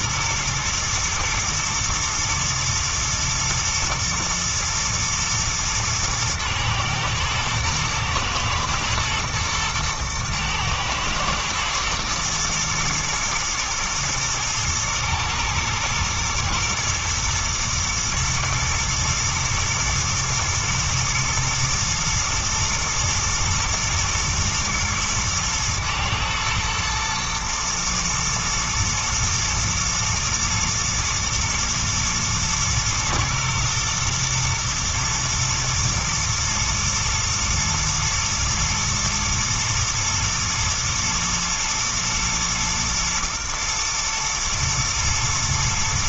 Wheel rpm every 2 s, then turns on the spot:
120, 120, 110, 110, 120, 110, 110, 110, 110, 110, 120, 120, 120, 120, 120, 110, 120, 120, 110, 110, 110, 110, 110.
none